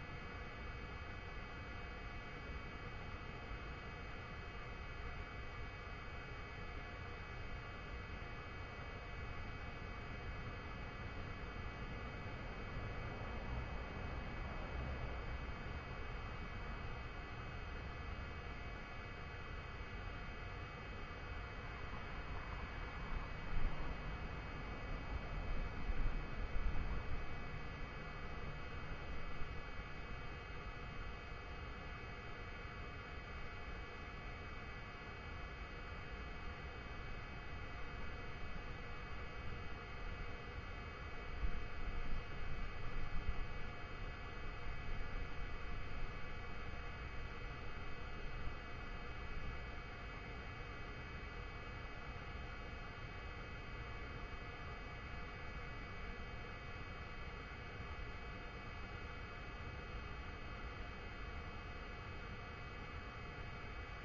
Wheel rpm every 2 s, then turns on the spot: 0, 0, 0, 0, 0, 0, 0, 0, 0, 0, 0, 0, 0, 0, 0, 0, 0, 0, 0, 0, 0, 0, 0, 0, 0, 0, 0, 0, 0, 0, 0, 0.
none